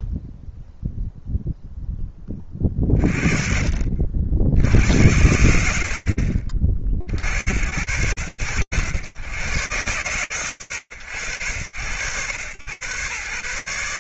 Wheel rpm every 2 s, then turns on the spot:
0, 20, 90, 60, 90, 100, 110.
none